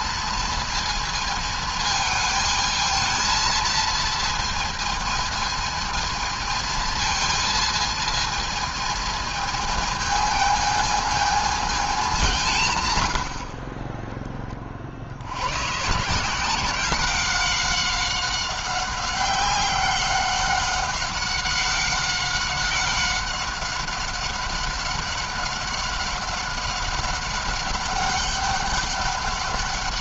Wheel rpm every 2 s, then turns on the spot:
230, 220, 220, 220, 220, 220, 160, 20, 180, 190, 190, 190, 190, 190, 200.
none